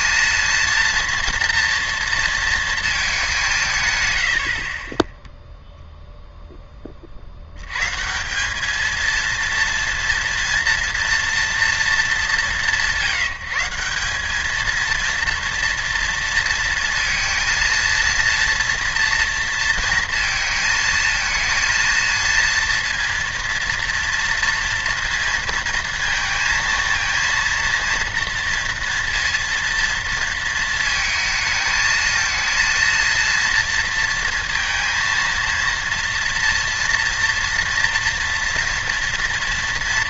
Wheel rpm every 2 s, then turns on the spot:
230, 220, 40, 10, 210, 230, 160, 230, 230, 230, 230, 230, 230, 220, 230, 220, 230, 230, 230, 230.
none